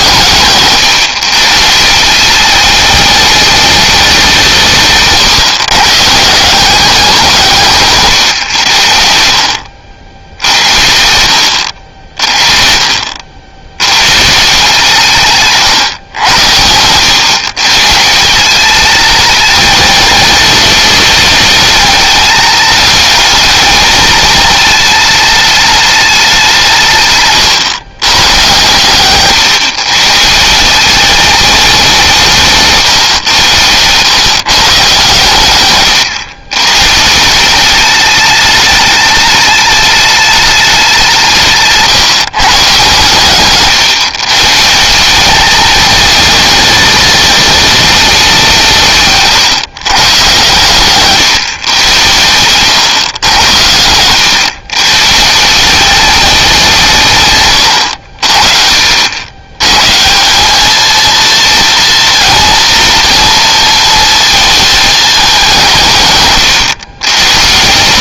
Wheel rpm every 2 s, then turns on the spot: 130, 210, 140, 190, 60, 70, 50, 160, 100, 210, 210, 210, 220, 160, 130, 200, 130, 130, 140, 210, 190, 140, 180, 220, 160, 140, 110, 140, 160, 60, 220, 230, 210, 140.
4-6 50-52